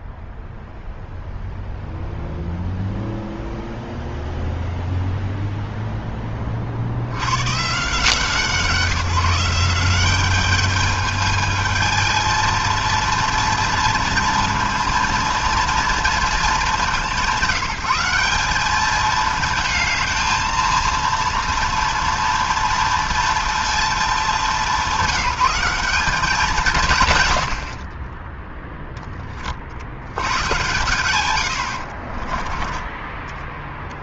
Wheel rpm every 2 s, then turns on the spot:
0, 0, 0, 100, 180, 220, 230, 230, 180, 220, 230, 230, 180, 100, 50, 100, 10.
32-34